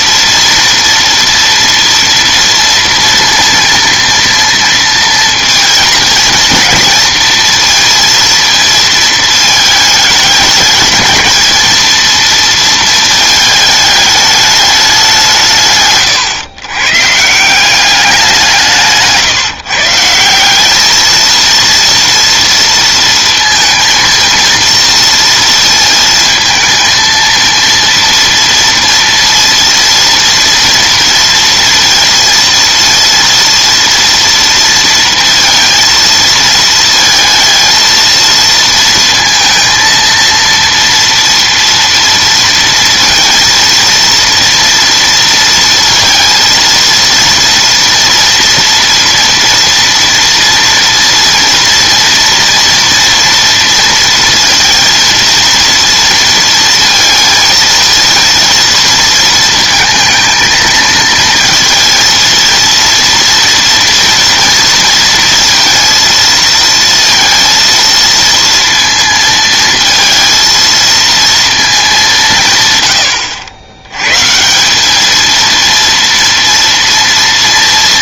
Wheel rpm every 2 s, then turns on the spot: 230, 230, 230, 230, 230, 210, 230, 210, 120, 170, 190, 230, 230, 230, 230, 230, 230, 230, 230, 230, 230, 230, 230, 230, 240, 230, 230, 230, 230, 230, 230, 230, 230, 230, 230, 230, 140, 180, 230.
none